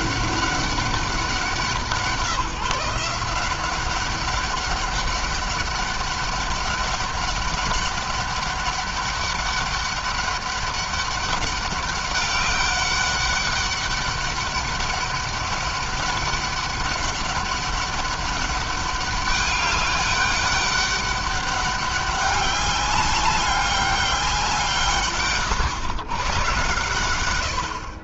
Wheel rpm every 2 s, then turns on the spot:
190, 170, 200, 200, 200, 200, 200, 200, 190, 200, 200, 200, 160, 110.
none